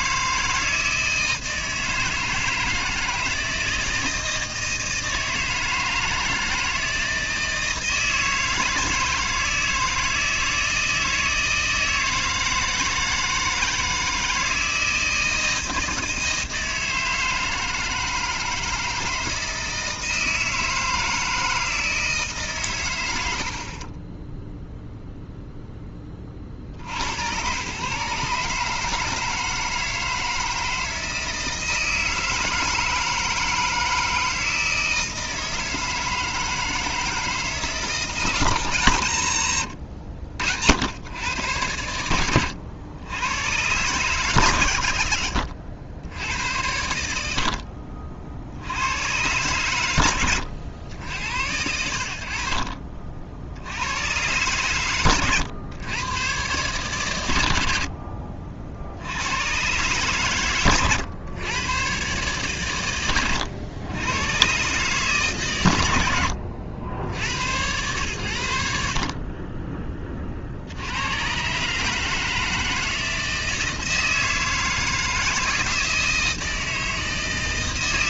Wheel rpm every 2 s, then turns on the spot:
160, 160, 160, 160, 160, 160, 160, 160, 160, 160, 160, 110, 0, 60, 150, 160, 160, 160, 160, 150, 90, 100, 90, 100, 80, 90, 50, 120, 130, 70, 120, 120, 130, 90, 70, 80, 160, 160, 160.
none